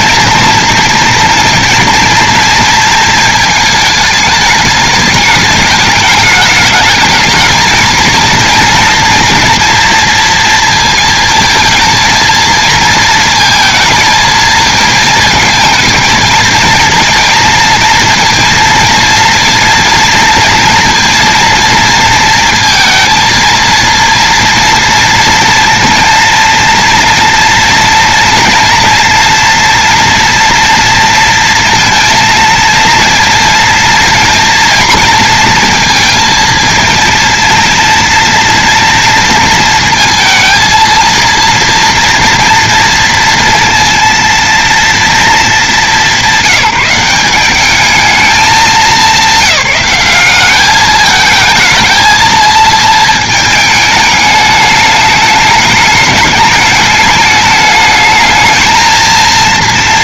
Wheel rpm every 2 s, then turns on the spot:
230, 230, 210, 210, 230, 230, 220, 230, 230, 230, 230, 230, 230, 230, 230, 230, 230, 240, 230, 230, 220, 230, 230, 180, 200, 200, 230, 210, 210, 220.
none